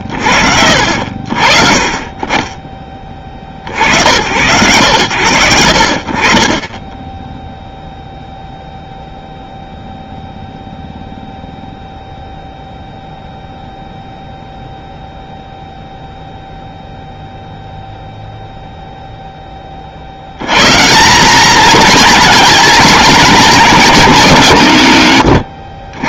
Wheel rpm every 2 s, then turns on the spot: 80, 30, 90, 30, 0, 0, 0, 0, 0, 0, 100, 220, 130.
none